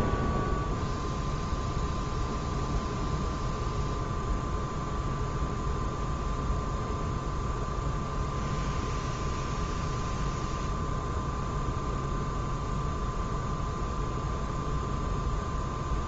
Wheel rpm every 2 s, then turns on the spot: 0, 0, 0, 0, 0, 0, 0, 0.
none